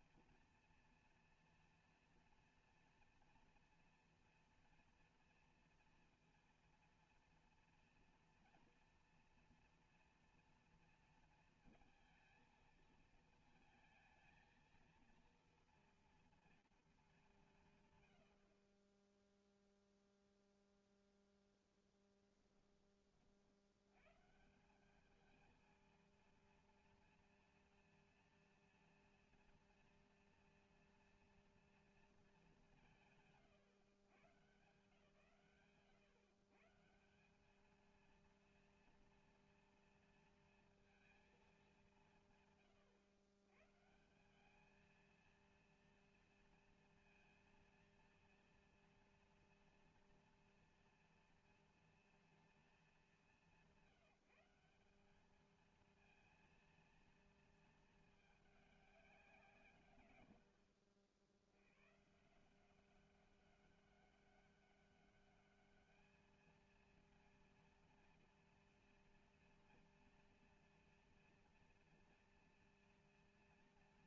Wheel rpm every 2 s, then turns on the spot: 240, 240, 230, 230, 230, 230, 230, 230, 210, 0, 0, 30, 200, 230, 230, 230, 130, 100, 220, 230, 200, 130, 230, 230, 230, 230, 190, 210, 230, 190, 70, 190, 200, 230, 230, 230, 230.
none